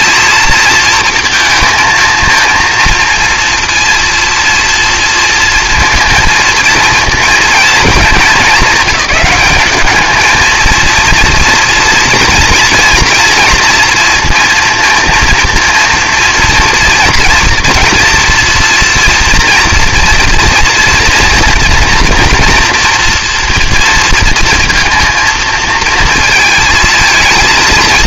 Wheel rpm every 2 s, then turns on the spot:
230, 230, 230, 230, 200, 230, 230, 230, 230, 240, 230, 230, 230, 220.
none